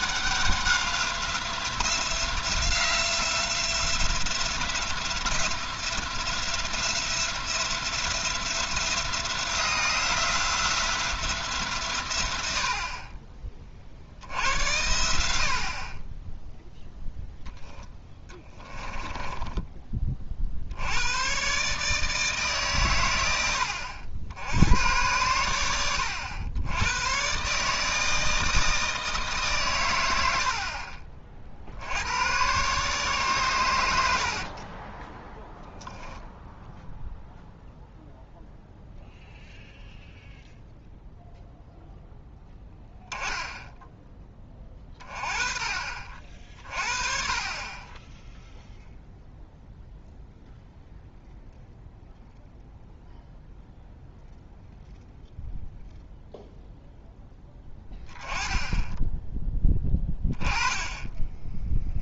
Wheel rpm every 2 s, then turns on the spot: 190, 180, 180, 170, 170, 170, 60, 80, 0, 10, 70, 140, 90, 100, 160, 60, 130, 30, 0, 0, 0, 20, 20, 40, 0, 0, 0, 0, 0, 10, 10.
18-20 34-36